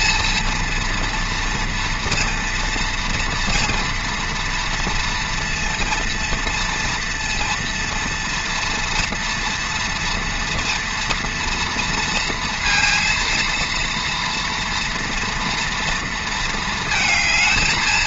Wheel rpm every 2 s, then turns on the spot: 230, 240, 230, 230, 230, 240, 230, 230, 220.
none